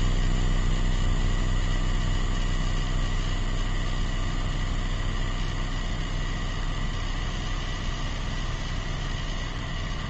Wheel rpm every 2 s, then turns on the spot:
0, 0, 0, 0, 0.
none